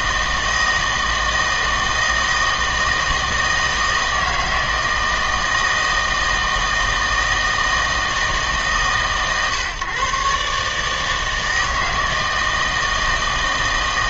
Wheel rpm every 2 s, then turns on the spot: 160, 160, 160, 160, 150, 140, 160.
none